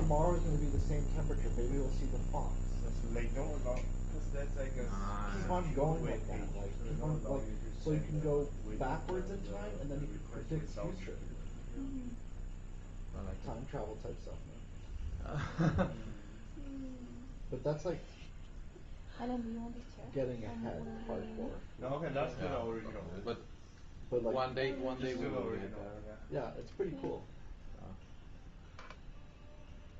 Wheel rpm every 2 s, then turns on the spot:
0, 0, 0, 0, 0, 0, 0, 0, 0, 0, 0, 0, 0, 0, 0.
none